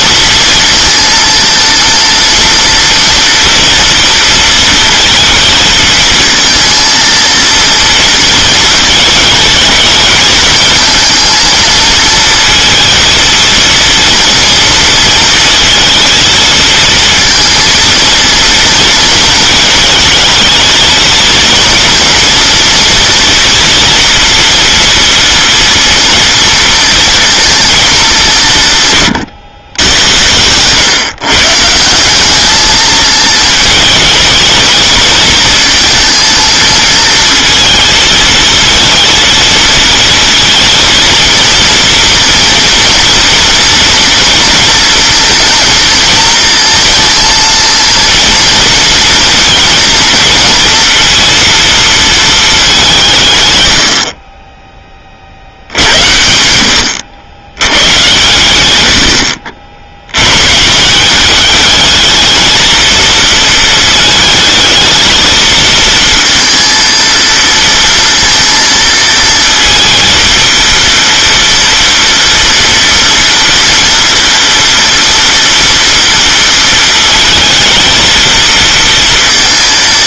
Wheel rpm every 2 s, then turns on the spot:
230, 230, 230, 230, 220, 220, 230, 230, 230, 230, 220, 230, 230, 230, 160, 110, 210, 220, 230, 220, 230, 230, 230, 220, 230, 230, 200, 20, 80, 110, 140, 220, 220, 230, 230, 230, 230, 230, 230, 230.
30-32